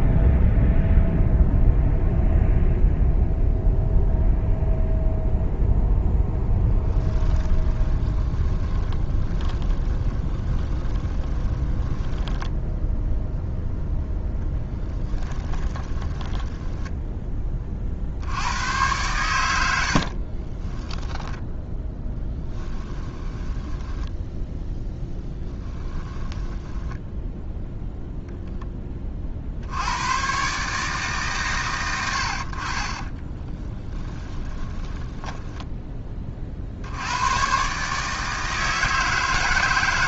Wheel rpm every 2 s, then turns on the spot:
0, 0, 0, 10, 20, 20, 0, 10, 10, 100, 10, 10, 0, 10, 20, 140, 40, 10, 70, 160.
6-12 14-18 20-24 32-36